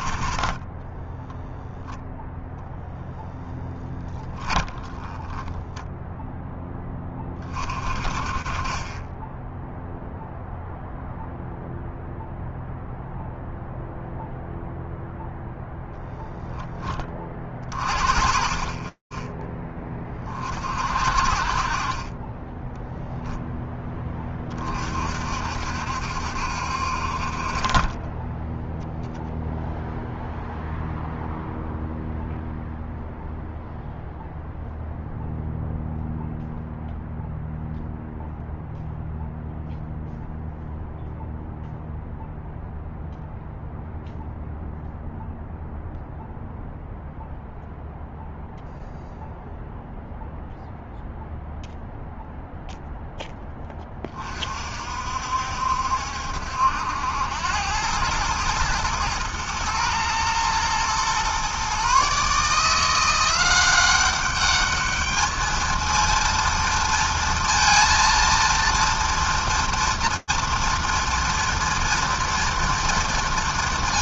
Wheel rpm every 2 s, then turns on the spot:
40, 0, 20, 10, 20, 0, 0, 0, 0, 30, 40, 10, 30, 70, 20, 0, 0, 0, 0, 0, 0, 0, 0, 0, 0, 0, 0, 40, 70, 110, 120, 160, 210, 230, 230, 230, 230.
0-2 4-6